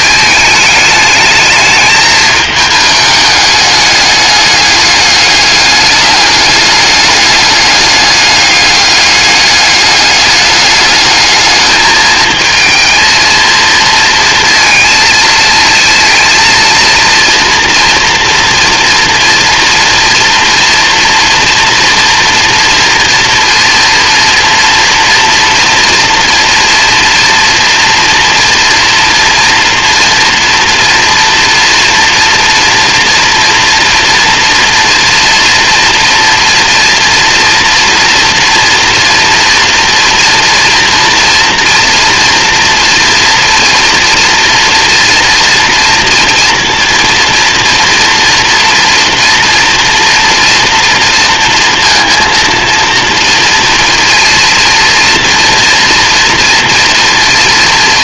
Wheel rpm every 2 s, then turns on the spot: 210, 210, 210, 210, 210, 210, 220, 220, 230, 230, 230, 230, 240, 230, 230, 230, 240, 230, 230, 240, 240, 240, 230, 230, 230, 230, 230, 240, 230.
none